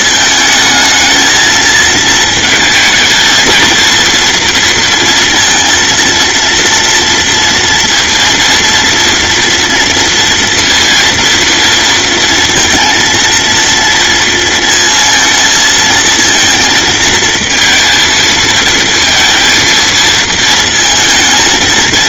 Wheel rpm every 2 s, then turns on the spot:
230, 220, 230, 230, 230, 230, 230, 230, 230, 230, 230.
none